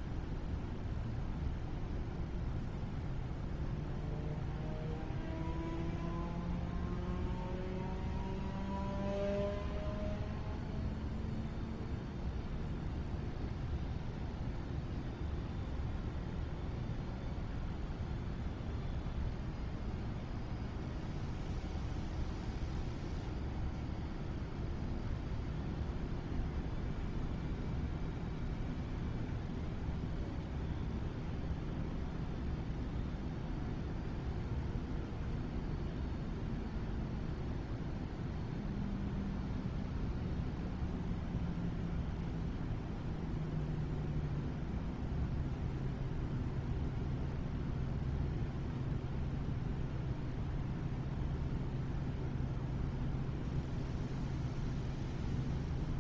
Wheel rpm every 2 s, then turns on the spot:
0, 0, 0, 0, 0, 0, 0, 0, 0, 0, 0, 0, 0, 0, 0, 0, 0, 0, 0, 0, 0, 0, 0, 0, 0, 0, 0, 0.
none